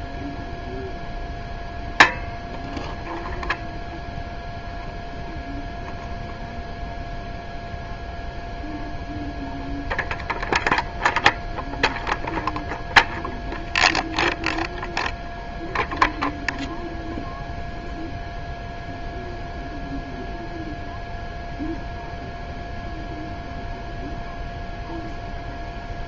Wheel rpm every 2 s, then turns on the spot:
0, 0, 0, 0, 0, 0, 0, 0, 0, 0, 0, 0, 0.
none